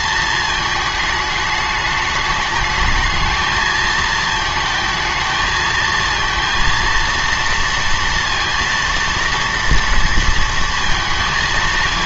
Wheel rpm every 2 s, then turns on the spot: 220, 220, 220, 230, 230, 230.
none